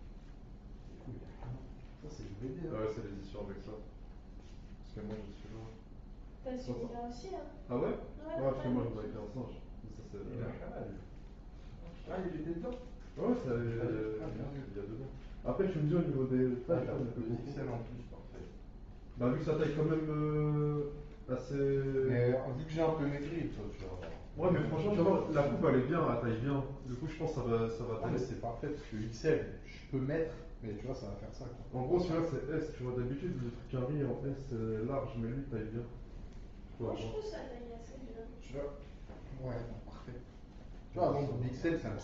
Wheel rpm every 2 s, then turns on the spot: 0, 0, 0, 0, 0, 0, 0, 0, 0, 0, 0, 0, 0, 0, 0, 0, 0, 0, 0, 0, 0.
none